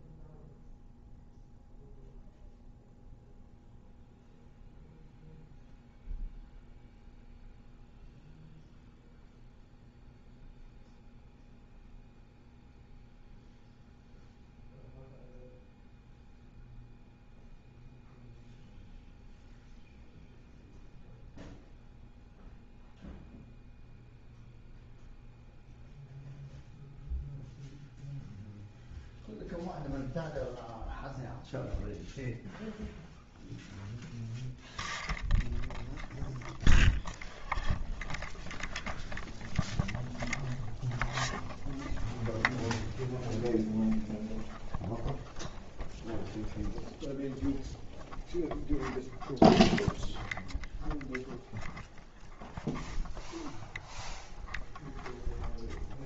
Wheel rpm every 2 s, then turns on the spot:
0, 0, 0, 0, 0, 0, 0, 0, 0, 0, 0, 0, 0, 0, 0, 0, 0, 0, 0, 0, 0, 0, 0, 0, 0, 0, 0, 0.
none